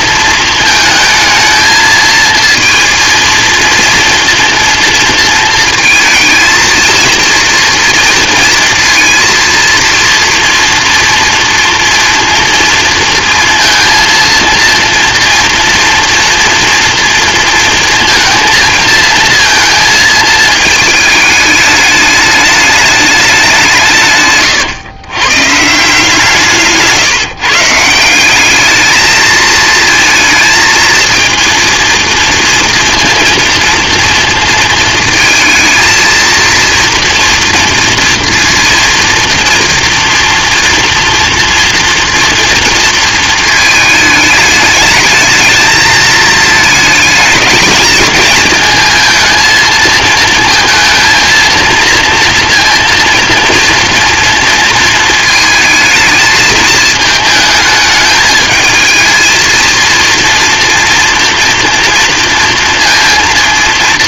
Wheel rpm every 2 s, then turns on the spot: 220, 230, 230, 230, 230, 230, 230, 230, 230, 230, 220, 210, 130, 150, 210, 230, 230, 230, 230, 230, 230, 240, 220, 220, 220, 230, 230, 230, 220, 220, 230, 230.
none